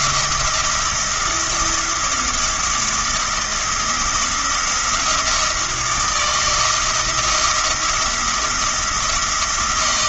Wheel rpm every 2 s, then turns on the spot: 170, 170, 170, 160, 170.
none